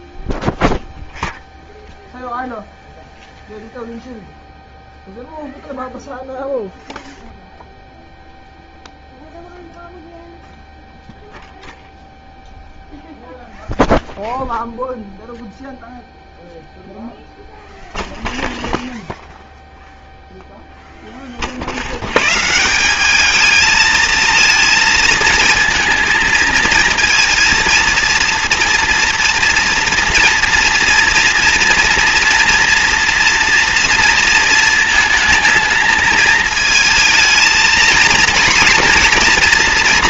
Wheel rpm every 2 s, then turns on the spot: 0, 0, 0, 0, 0, 0, 0, 0, 0, 0, 10, 190, 220, 230, 230, 230, 230, 220, 220, 230.
none